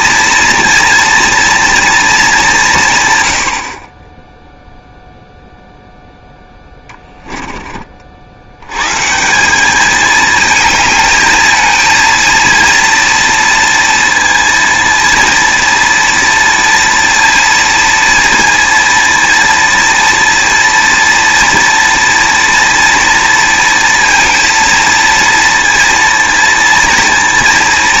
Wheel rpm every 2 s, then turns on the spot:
230, 160, 0, 10, 120, 220, 230, 230, 230, 230, 230, 230, 230, 230.
6-8